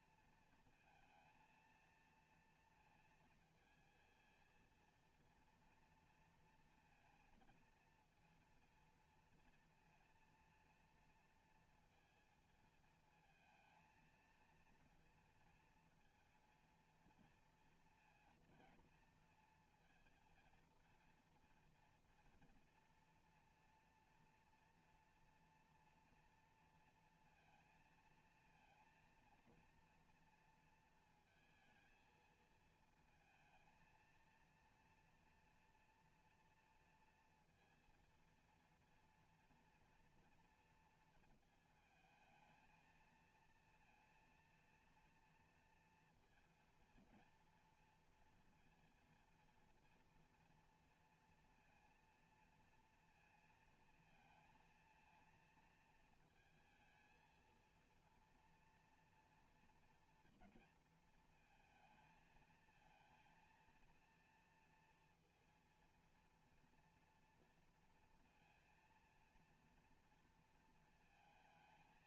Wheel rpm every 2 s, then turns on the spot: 230, 230, 230, 230, 230, 230, 220, 230, 230, 230, 230, 240, 240, 240, 230, 230, 220, 230, 230, 230, 230, 220, 230, 230, 230, 230, 230, 230, 220, 230, 230, 230, 230, 230, 230, 230.
none